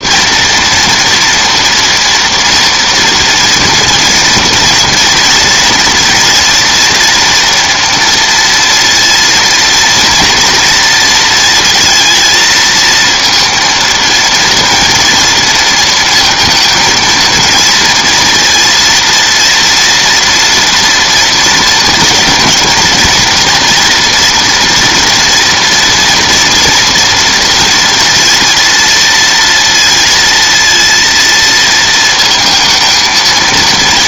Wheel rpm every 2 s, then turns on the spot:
240, 230, 240, 230, 230, 230, 230, 230, 230, 230, 240, 230, 240, 240, 230, 230, 220.
none